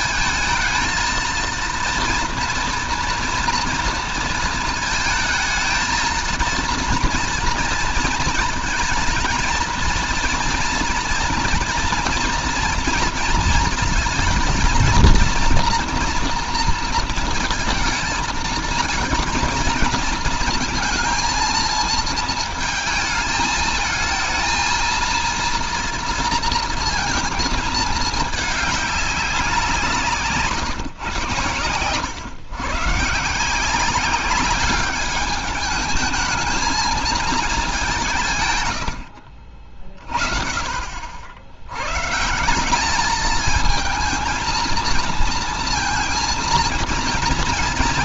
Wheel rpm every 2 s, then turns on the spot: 230, 240, 220, 220, 220, 240, 230, 230, 230, 220, 230, 220, 230, 230, 210, 150, 130, 200, 220, 100, 50, 200, 230, 230.
none